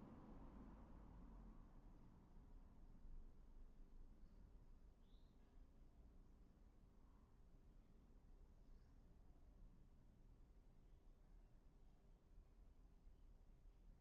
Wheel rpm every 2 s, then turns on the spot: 0, 0, 0, 0, 0, 0, 0.
none